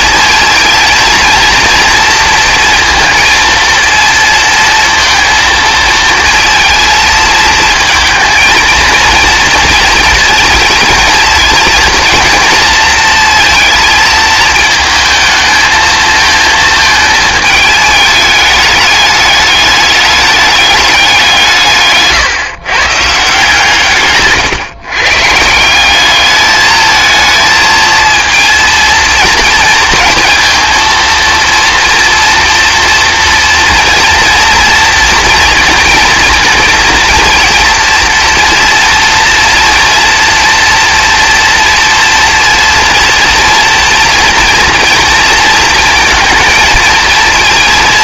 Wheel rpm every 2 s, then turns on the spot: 230, 230, 230, 230, 230, 230, 230, 220, 220, 210, 200, 140, 130, 220, 230, 230, 230, 230, 230, 240, 240, 230, 230, 220.
none